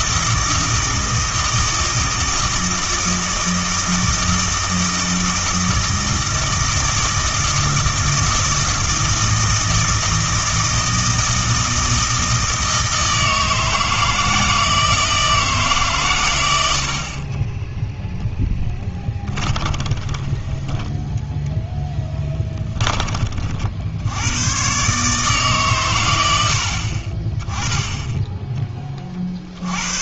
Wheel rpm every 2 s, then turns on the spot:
160, 160, 160, 160, 160, 160, 160, 160, 80, 10, 10, 20, 120, 60, 20.
18-20 22-24